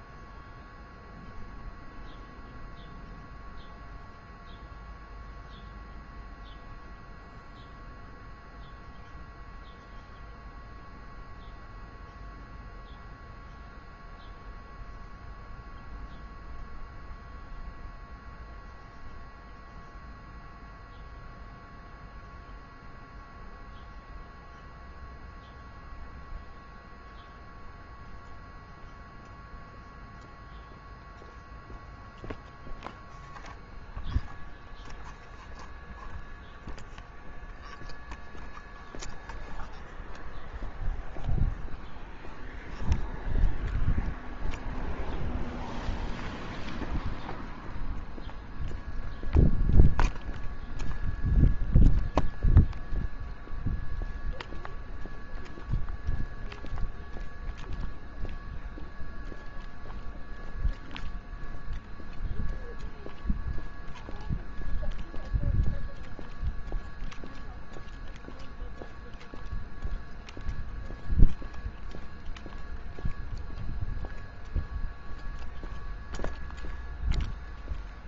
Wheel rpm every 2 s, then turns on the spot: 0, 0, 0, 0, 0, 0, 0, 0, 0, 0, 0, 0, 0, 0, 0, 0, 0, 0, 0, 0, 0, 0, 0, 0, 0, 0, 0, 0, 0, 0, 0, 0, 0, 0, 0, 0, 0, 0, 0.
none